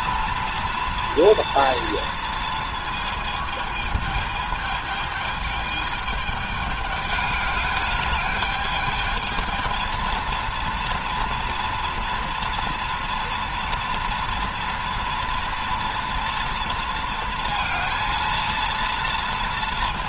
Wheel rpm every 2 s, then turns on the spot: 230, 230, 220, 210, 210, 230, 230, 230, 230, 230.
none